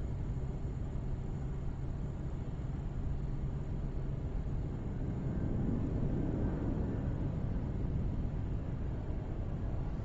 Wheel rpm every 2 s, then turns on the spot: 0, 0, 0, 0, 0.
none